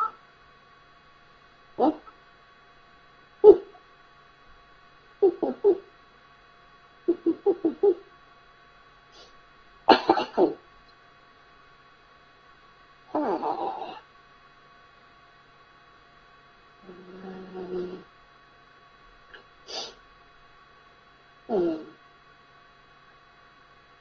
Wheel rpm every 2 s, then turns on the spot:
0, 0, 0, 0, 0, 0, 0, 0, 0, 0, 0, 0.
none